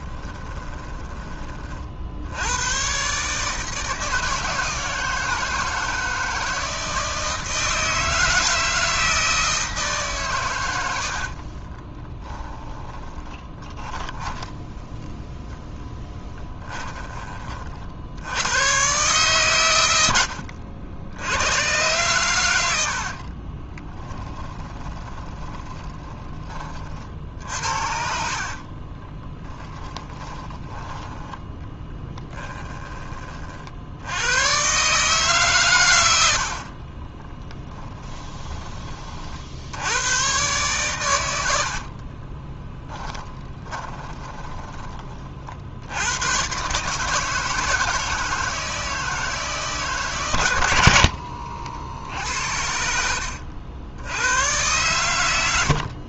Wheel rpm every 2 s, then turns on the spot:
20, 120, 160, 160, 160, 100, 20, 10, 20, 110, 80, 80, 20, 40, 40, 10, 10, 140, 50, 40, 130, 10, 20, 140, 160, 70, 70, 110.
0-2 12-14 16-18 22-26 28-30 36-38 42-44 50-52